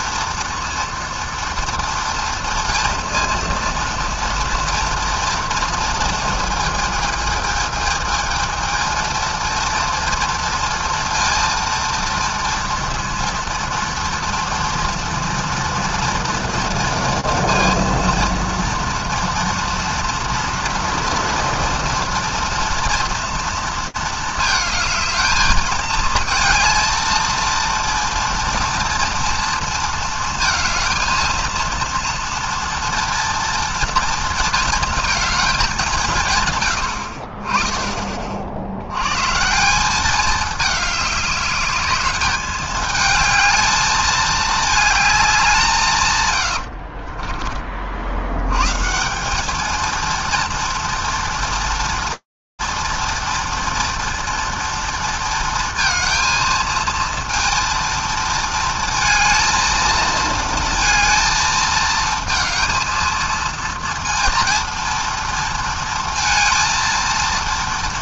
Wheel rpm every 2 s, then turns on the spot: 230, 230, 230, 230, 220, 230, 230, 230, 230, 230, 230, 230, 220, 220, 230, 230, 230, 230, 140, 50, 210, 210, 220, 100, 110, 230, 230, 230, 230, 230, 230, 220, 230, 230.
36-38 46-48